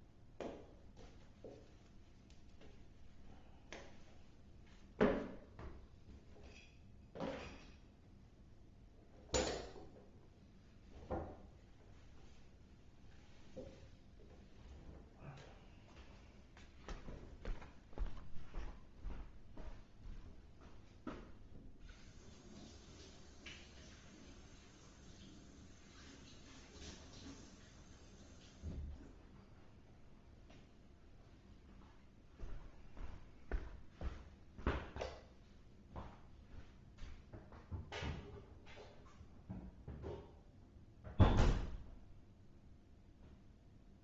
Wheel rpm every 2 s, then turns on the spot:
0, 0, 0, 0, 0, 0, 0, 0, 0, 0, 0, 0, 0, 0, 0, 0, 0, 0, 0, 0, 0, 0.
none